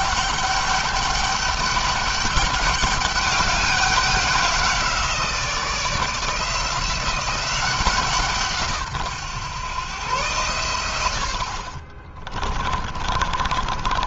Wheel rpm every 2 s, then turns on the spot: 200, 200, 180, 170, 140, 110, 30.
12-14